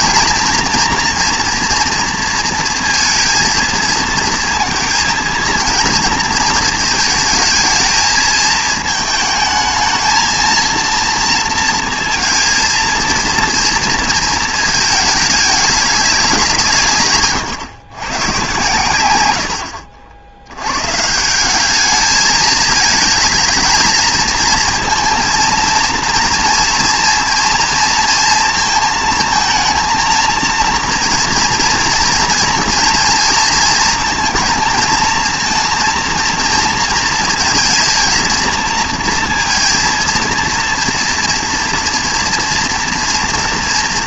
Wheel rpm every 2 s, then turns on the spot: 240, 230, 230, 220, 220, 230, 230, 230, 180, 110, 100, 210, 230, 230, 230, 230, 230, 220, 230, 230, 230, 240.
none